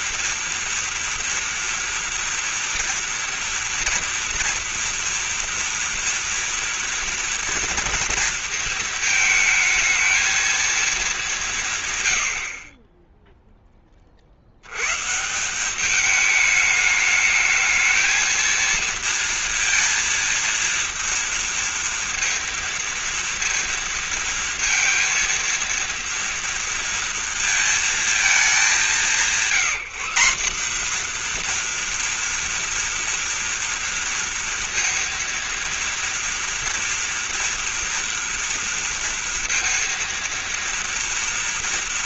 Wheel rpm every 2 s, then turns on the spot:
240, 230, 230, 230, 220, 220, 40, 100, 210, 230, 230, 230, 230, 230, 190, 220, 230, 230, 230, 230, 230.
none